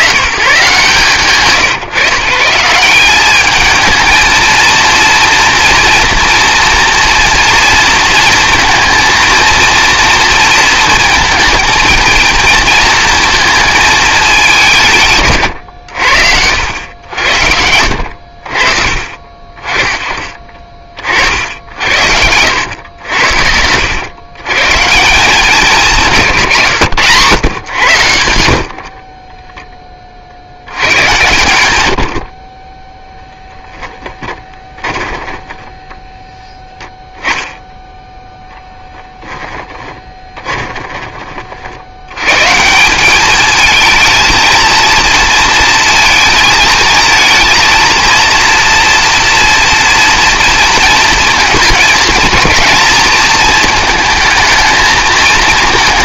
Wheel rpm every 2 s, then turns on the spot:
120, 180, 230, 230, 230, 230, 230, 160, 90, 40, 40, 90, 130, 120, 50, 90, 30, 10, 0, 10, 20, 150, 230, 220, 230, 230, 220, 220.
28-30 34-36 40-42